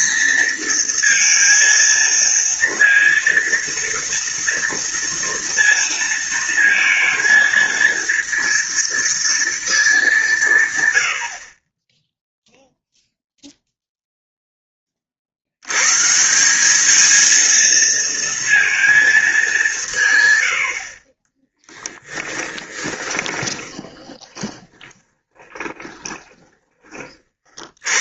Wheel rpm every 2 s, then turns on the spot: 230, 230, 230, 230, 230, 140, 0, 10, 190, 230, 90, 10, 20, 20.
22-26